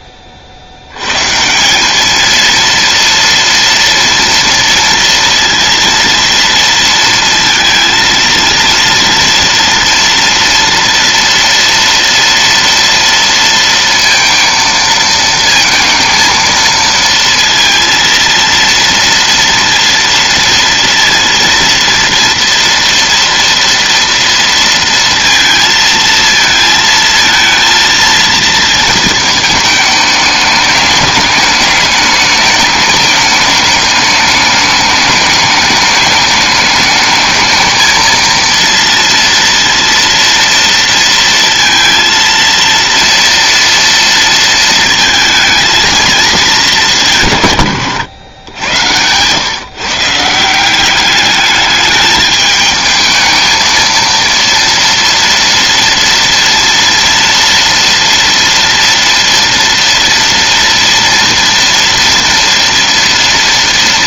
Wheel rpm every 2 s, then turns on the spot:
50, 230, 240, 230, 230, 230, 230, 230, 220, 230, 230, 230, 230, 220, 230, 210, 210, 210, 210, 230, 230, 230, 230, 210, 110, 170, 220, 230, 230, 230, 230, 230.
48-50